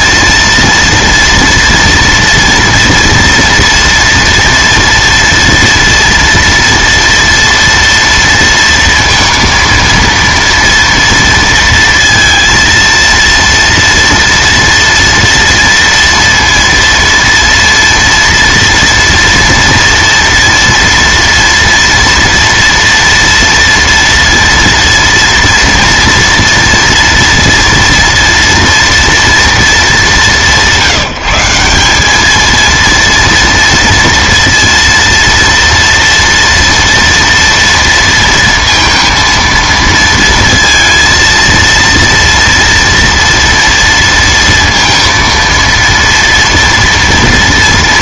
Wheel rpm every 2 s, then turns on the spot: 230, 230, 230, 230, 230, 230, 230, 230, 230, 230, 230, 230, 230, 230, 240, 170, 230, 230, 230, 230, 230, 230, 230, 230.
none